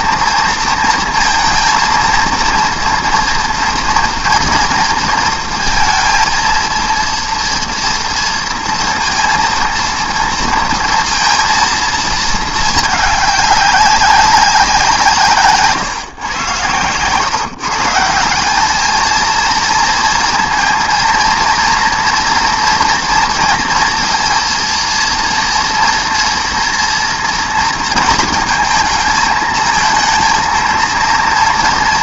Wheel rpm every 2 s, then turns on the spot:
230, 230, 230, 230, 230, 230, 220, 190, 120, 210, 230, 230, 230, 240, 220, 230.
none